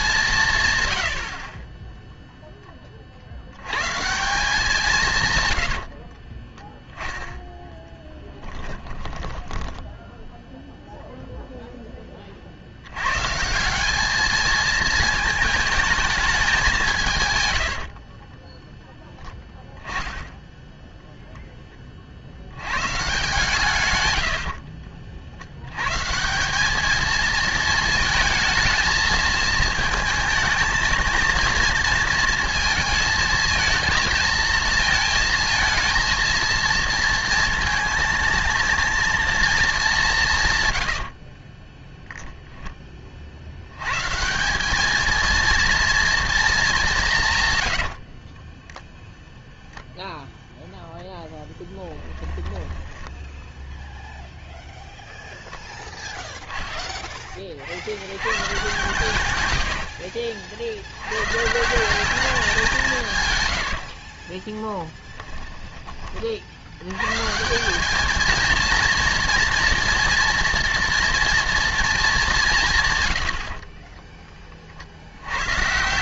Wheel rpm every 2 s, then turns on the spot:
130, 20, 170, 10, 20, 0, 70, 220, 180, 10, 0, 120, 50, 210, 220, 220, 230, 230, 230, 230, 120, 10, 200, 200, 10, 0, 10, 0, 0, 120, 70, 170, 20, 90, 230, 240, 150, 50.
8-10 24-26 40-42 52-54 64-66